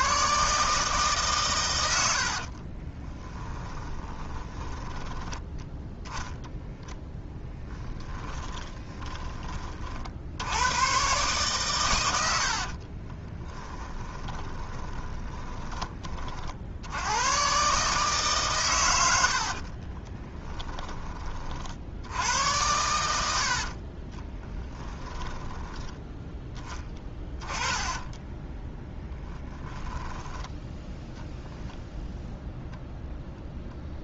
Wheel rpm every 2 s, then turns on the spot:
150, 30, 20, 0, 20, 110, 50, 20, 70, 120, 10, 90, 10, 10, 20, 10, 0.
2-6 8-10 12-16 24-26 28-30